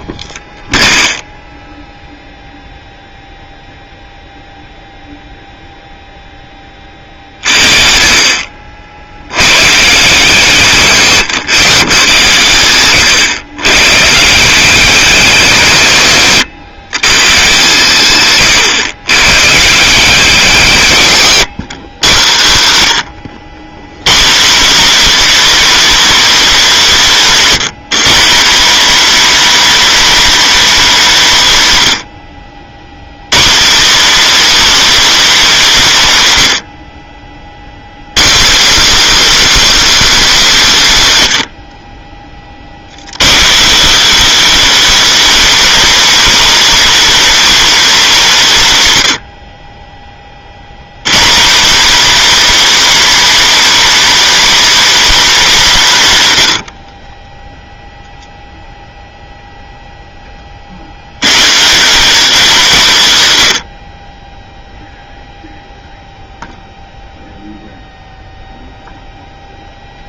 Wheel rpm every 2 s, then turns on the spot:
0, 0, 0, 30, 70, 130, 120, 180, 120, 110, 150, 140, 270, 240, 270, 250, 110, 330, 70, 280, 210, 110, 300, 290, 150, 130, 290, 290, 60, 0, 60, 200, 0, 0, 0.
none